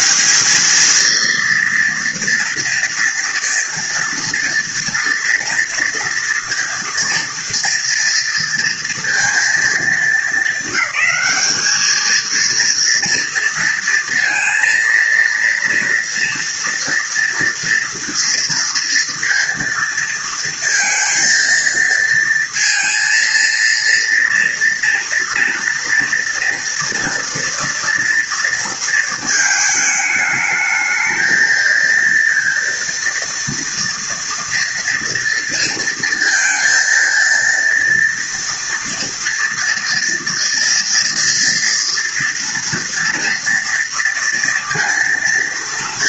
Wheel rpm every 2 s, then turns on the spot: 230, 230, 230, 230, 230, 210, 230, 230, 230, 230, 230, 230, 230, 230, 220, 220, 230, 230, 230, 230, 240, 230, 230.
none